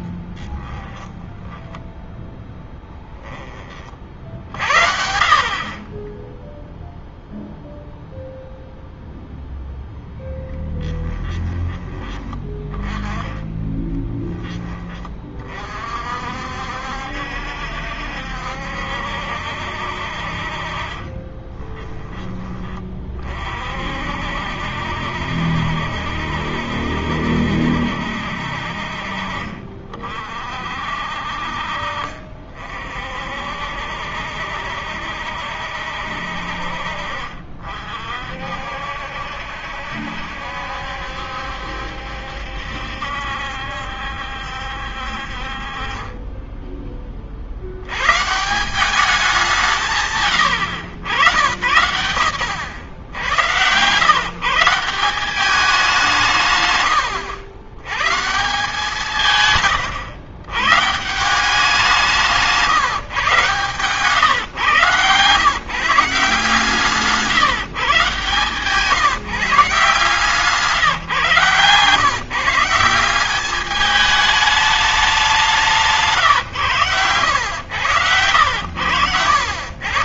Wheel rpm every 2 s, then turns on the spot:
30, 0, 50, 10, 0, 10, 20, 10, 60, 70, 50, 20, 60, 70, 60, 50, 50, 70, 60, 60, 70, 70, 70, 10, 150, 120, 110, 150, 120, 170, 120, 160, 130, 160, 130, 160, 160, 210, 140, 80.
0-2 6-8 10-12